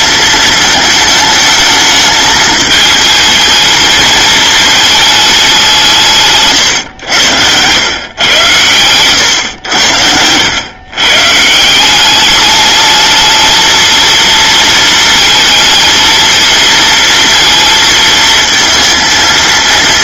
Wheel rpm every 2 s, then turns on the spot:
220, 220, 220, 130, 110, 110, 210, 230, 230, 230.
8-10